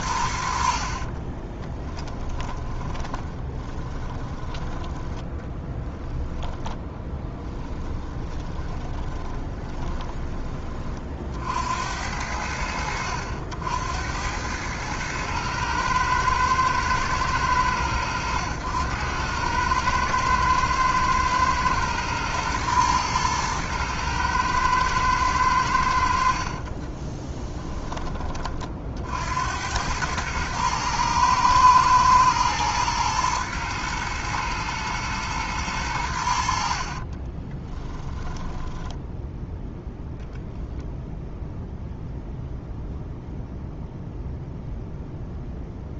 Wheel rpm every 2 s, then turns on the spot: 50, 20, 10, 10, 20, 30, 70, 110, 110, 100, 110, 110, 110, 20, 50, 110, 110, 110, 50, 10, 0, 0, 0.
0-4 6-10 26-28 36-40